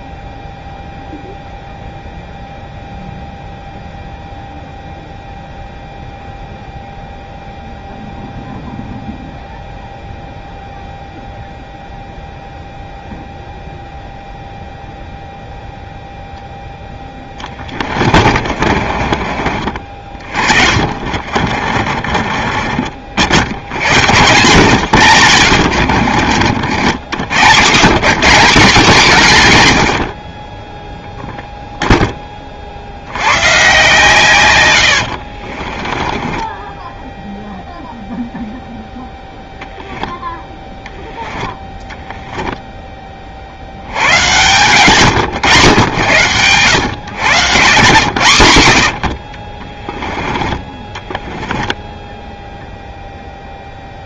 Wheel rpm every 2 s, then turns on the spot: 0, 0, 0, 0, 0, 0, 0, 0, 0, 40, 40, 40, 110, 70, 180, 10, 50, 100, 10, 0, 10, 10, 110, 100, 90, 20, 0.
18-22 24-28 34-38 50-52